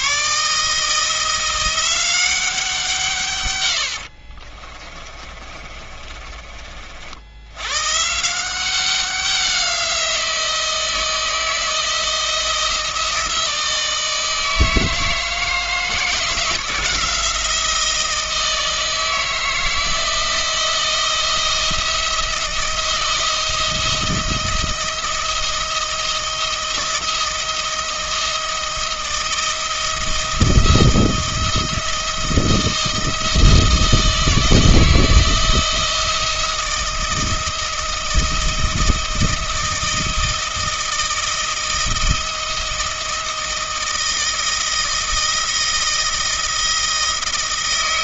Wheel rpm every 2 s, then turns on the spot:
160, 170, 30, 50, 190, 160, 170, 160, 170, 160, 170, 170, 170, 170, 160, 160, 160, 160, 170, 160, 160, 160, 160, 160.
4-6